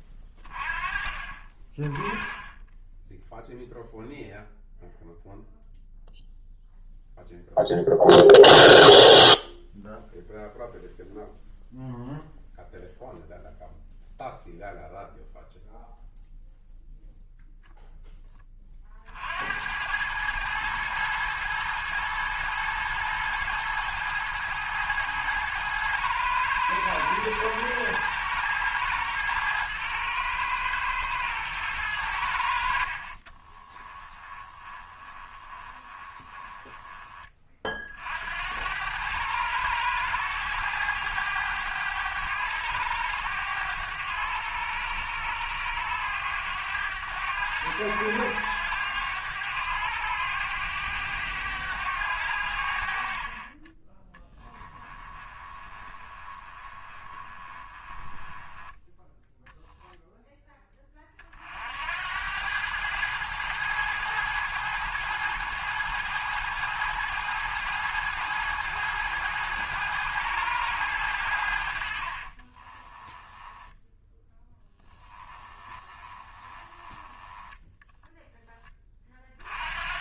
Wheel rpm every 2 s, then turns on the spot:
30, 10, 0, 0, 0, 0, 0, 0, 0, 40, 110, 110, 110, 110, 110, 110, 60, 20, 20, 90, 100, 100, 100, 100, 100, 100, 60, 10, 20, 10, 20, 100, 110, 110, 110, 100, 20, 10, 20, 20.
34-38 54-60 72-78